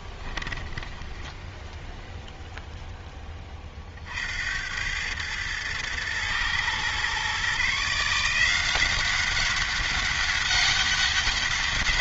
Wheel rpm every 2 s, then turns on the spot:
10, 0, 90, 120, 180, 200.
none